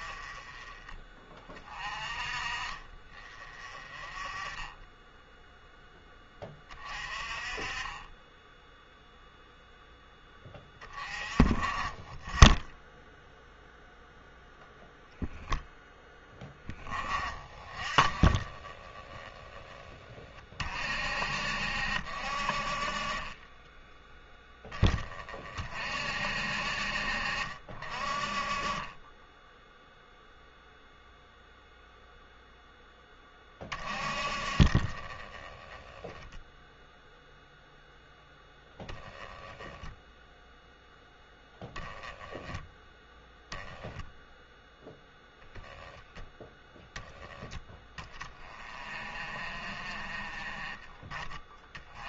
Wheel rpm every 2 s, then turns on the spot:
30, 30, 10, 30, 0, 20, 10, 0, 20, 30, 40, 50, 20, 60, 30, 0, 10, 40, 0, 10, 0, 10, 0, 10, 30, 20.
none